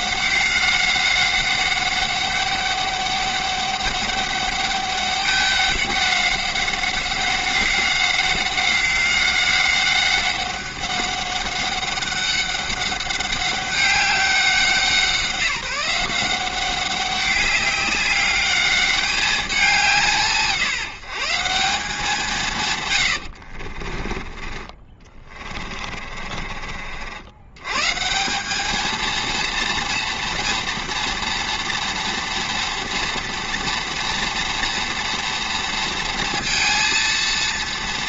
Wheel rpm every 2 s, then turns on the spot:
190, 200, 200, 190, 190, 190, 200, 180, 190, 200, 170, 150, 30, 50, 210, 240, 230, 230, 230.
26-28